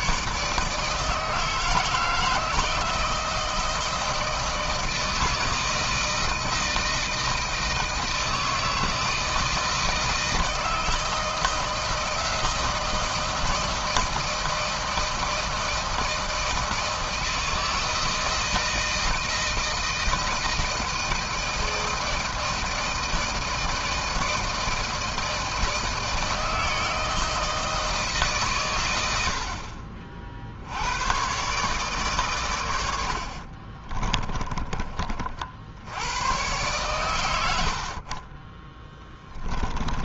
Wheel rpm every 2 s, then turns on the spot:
160, 160, 160, 160, 160, 160, 170, 160, 160, 160, 160, 160, 160, 160, 100, 100, 80, 40, 110, 10.
none